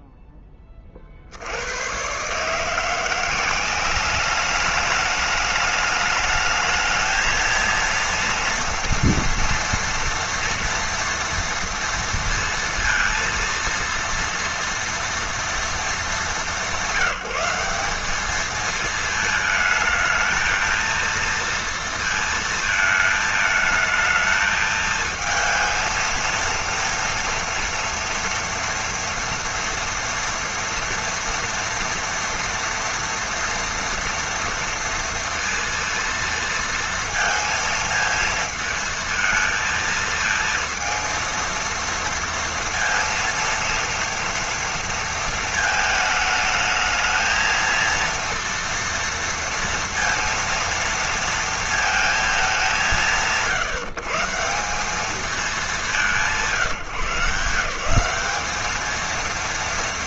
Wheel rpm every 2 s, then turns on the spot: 20, 160, 210, 220, 230, 230, 230, 230, 180, 220, 220, 220, 220, 230, 230, 230, 230, 230, 230, 220, 230, 230, 230, 220, 230, 230, 160, 170, 170, 210.
none